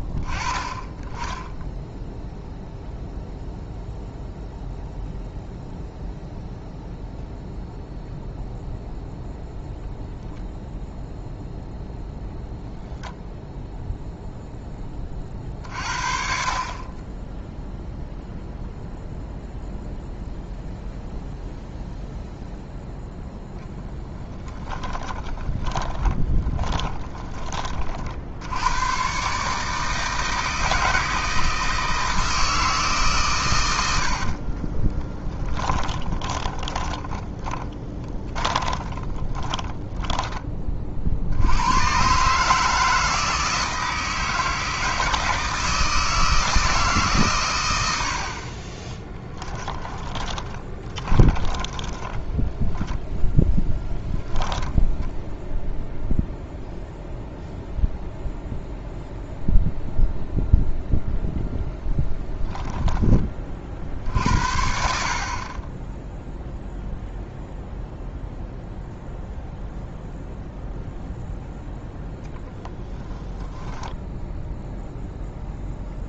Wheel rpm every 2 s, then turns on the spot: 20, 0, 0, 0, 0, 0, 0, 10, 30, 0, 0, 0, 20, 20, 100, 160, 160, 30, 20, 30, 40, 160, 160, 160, 30, 30, 20, 0, 0, 0, 0, 10, 60, 0, 0, 0, 10, 0.
24-28 34-40 48-52 62-64